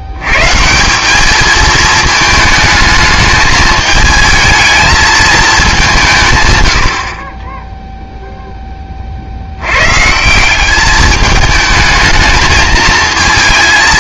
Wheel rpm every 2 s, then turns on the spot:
190, 220, 220, 80, 20, 190, 220.
none